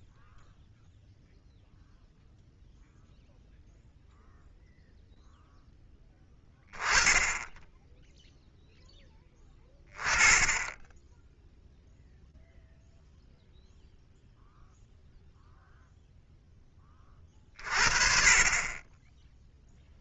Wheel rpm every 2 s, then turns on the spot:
0, 0, 0, 10, 0, 20, 0, 0, 30, 10.
10-12